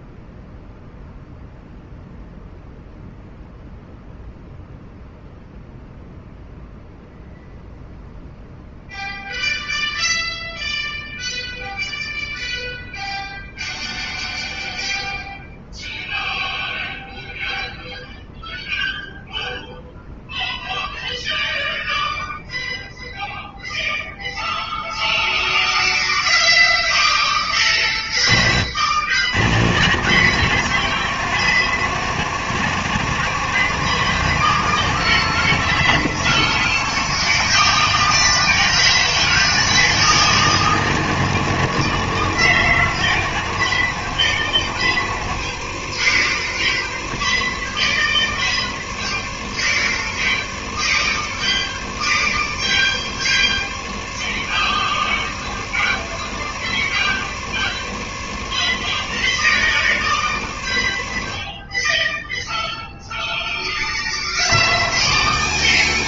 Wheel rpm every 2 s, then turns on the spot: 0, 0, 0, 0, 0, 0, 0, 0, 0, 0, 0, 0, 0, 10, 70, 110, 110, 110, 110, 120, 110, 100, 80, 70, 70, 70, 70, 70, 70, 70, 40, 0, 90.
none